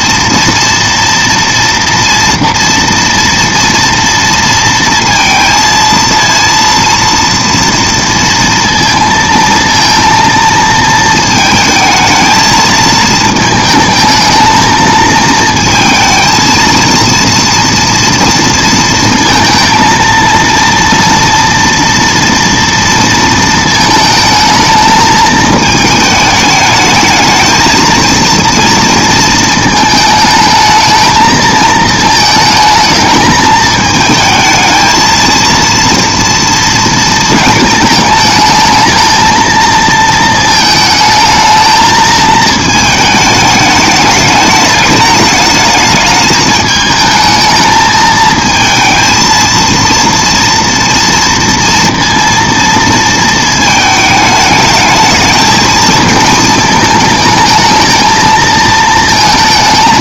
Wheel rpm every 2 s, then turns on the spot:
240, 230, 230, 230, 230, 220, 220, 220, 230, 230, 230, 230, 220, 210, 230, 220, 220, 220, 230, 220, 220, 220, 210, 220, 220, 230, 230, 220, 220, 220.
none